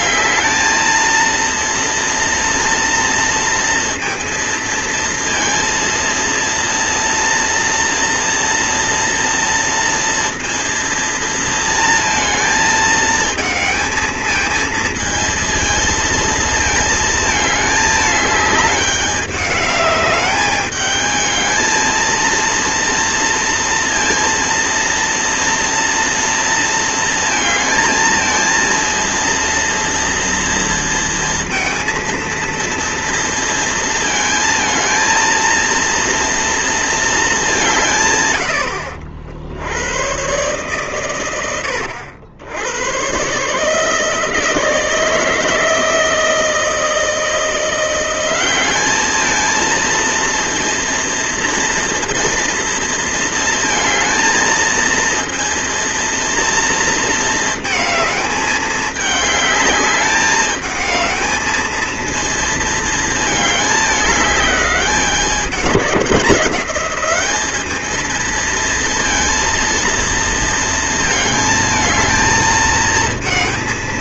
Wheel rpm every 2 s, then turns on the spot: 220, 230, 230, 230, 230, 230, 220, 220, 230, 210, 210, 230, 230, 230, 230, 230, 230, 230, 230, 70, 120, 90, 160, 160, 190, 230, 230, 230, 230, 210, 210, 230, 210, 190, 230, 230, 230.
none